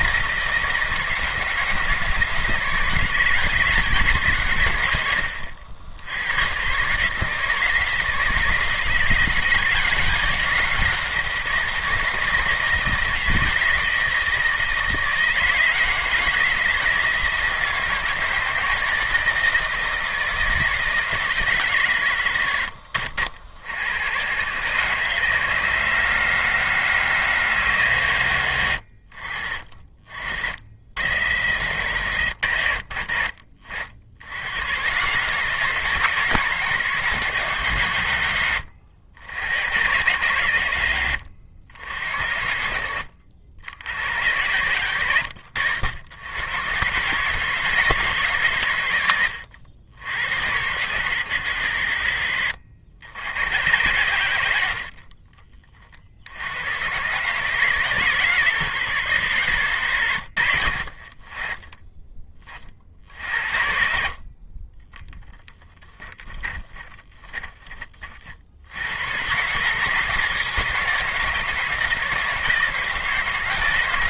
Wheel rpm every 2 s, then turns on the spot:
160, 150, 100, 130, 160, 180, 160, 160, 160, 160, 150, 60, 130, 160, 80, 80, 70, 120, 140, 80, 80, 60, 90, 120, 100, 90, 60, 60, 120, 110, 50, 50, 10, 20, 90, 170, 160.
44-46 64-68